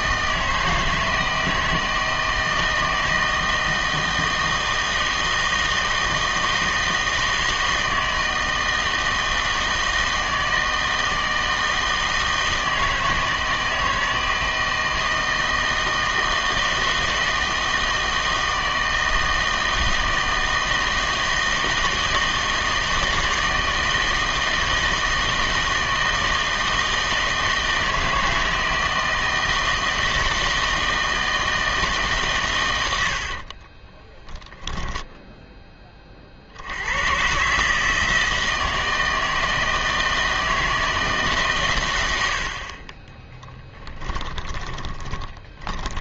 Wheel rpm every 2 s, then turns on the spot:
160, 160, 160, 160, 160, 160, 160, 160, 160, 160, 160, 160, 160, 160, 160, 160, 110, 10, 90, 160, 160, 40, 10.
34-36 44-46